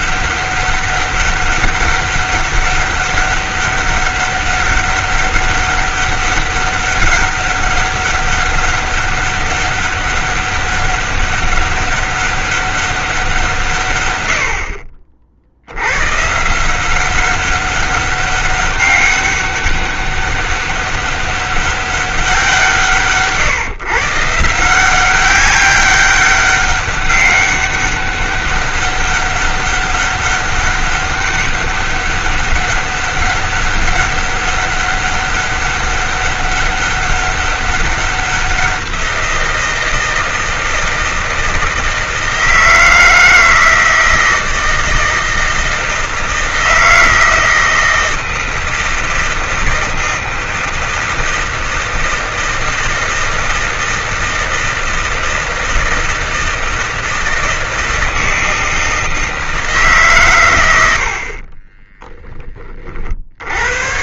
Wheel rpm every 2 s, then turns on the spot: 200, 200, 200, 200, 200, 200, 200, 60, 170, 200, 200, 180, 170, 200, 200, 200, 200, 200, 200, 180, 160, 160, 160, 160, 160, 160, 160, 160, 160, 160, 100, 30.
none